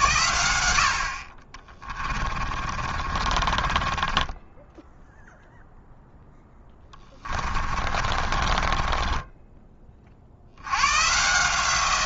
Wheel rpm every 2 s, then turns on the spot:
70, 30, 0, 20, 30, 90.
2-4 6-10